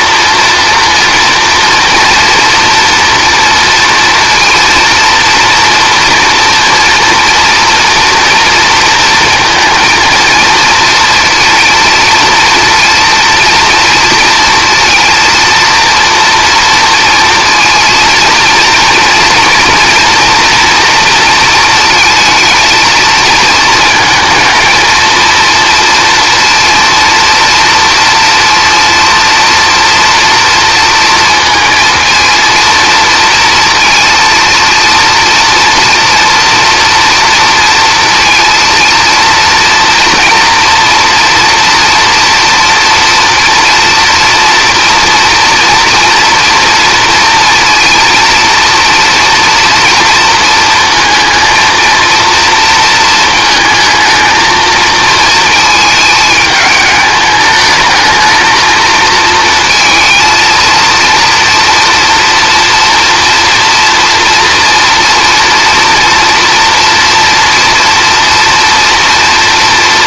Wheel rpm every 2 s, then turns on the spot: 230, 230, 230, 230, 230, 230, 230, 230, 240, 230, 230, 230, 230, 230, 230, 230, 230, 230, 240, 230, 240, 230, 230, 230, 230, 220, 230, 220, 210, 230, 230, 230, 230, 230, 240.
none